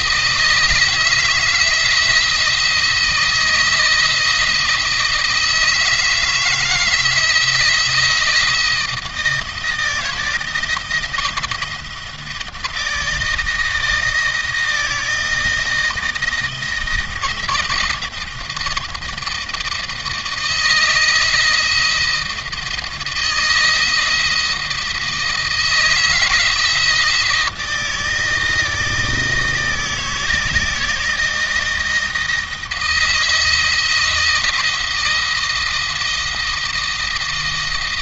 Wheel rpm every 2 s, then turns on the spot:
160, 170, 160, 160, 170, 170, 160, 160, 160, 160, 160, 160, 170, 160, 160, 160, 160, 160, 160.
none